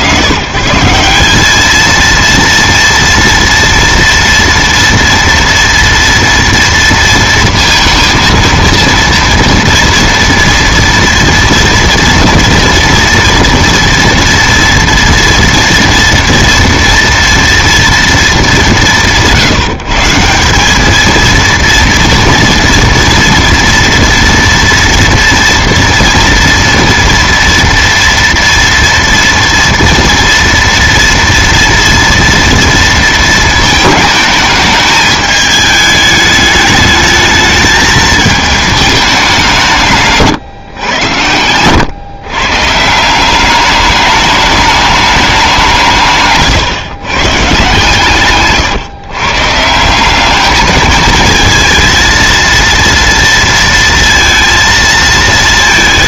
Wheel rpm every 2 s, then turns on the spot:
150, 230, 230, 230, 230, 230, 230, 230, 230, 200, 190, 240, 230, 230, 230, 230, 230, 210, 210, 220, 120, 150, 210, 140, 130, 210, 230, 230.
none